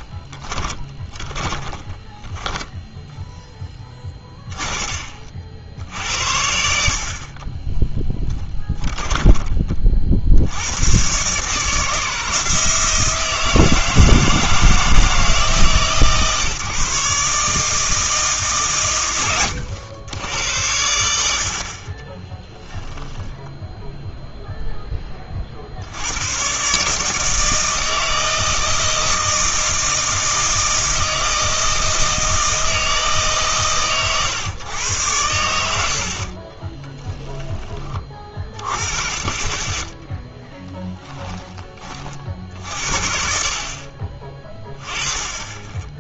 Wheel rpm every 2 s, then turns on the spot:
20, 10, 40, 60, 20, 100, 160, 160, 150, 130, 80, 10, 0, 130, 160, 160, 160, 110, 20, 30, 10, 60, 20.
0-2 4-6 8-10 22-24 36-38 40-42